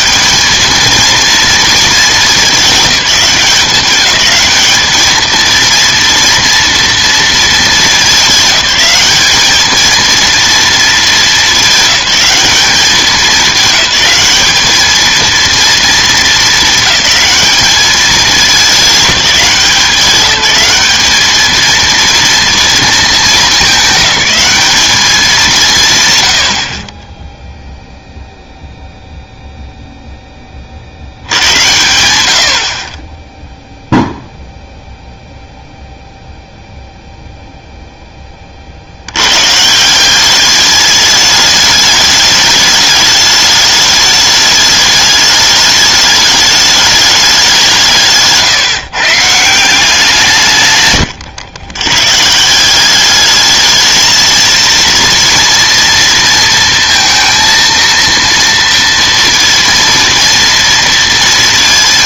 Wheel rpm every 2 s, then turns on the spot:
210, 210, 210, 230, 200, 230, 210, 210, 220, 200, 200, 230, 210, 70, 0, 30, 70, 0, 0, 40, 200, 210, 210, 210, 150, 140, 170, 230, 230, 230, 230.
none